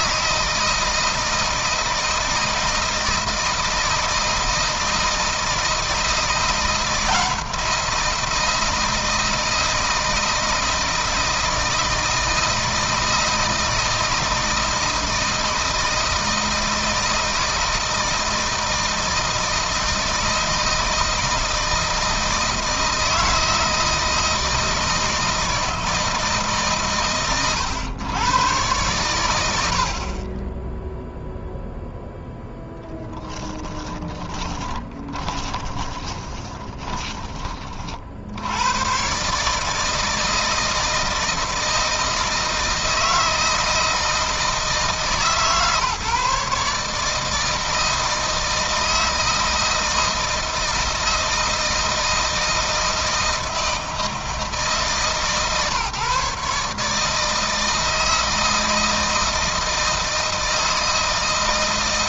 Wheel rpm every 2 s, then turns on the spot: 160, 160, 160, 170, 160, 160, 160, 160, 160, 160, 160, 160, 160, 140, 110, 10, 10, 30, 20, 110, 160, 160, 160, 150, 160, 160, 160, 150, 150, 160, 160.
34-38